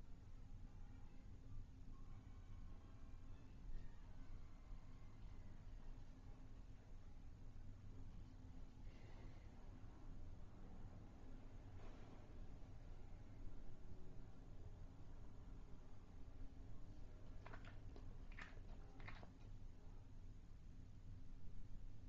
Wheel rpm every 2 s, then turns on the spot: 0, 0, 0, 0, 0, 0, 0, 0, 0, 0, 0.
none